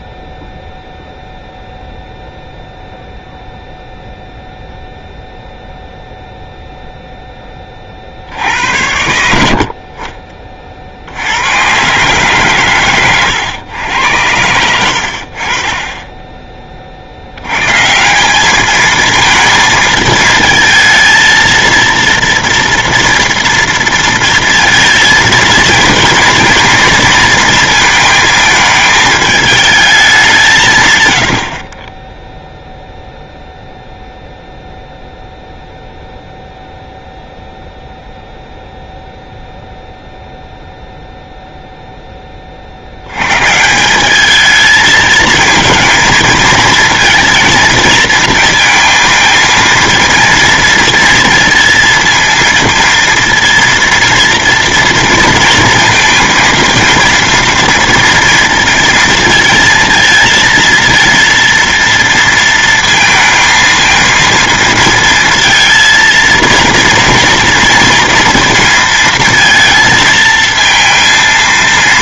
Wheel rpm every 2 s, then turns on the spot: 0, 0, 0, 0, 80, 50, 120, 90, 30, 210, 230, 240, 230, 230, 220, 140, 0, 0, 0, 0, 0, 60, 220, 230, 230, 230, 230, 230, 230, 230, 230, 230, 230, 230, 230, 230.
none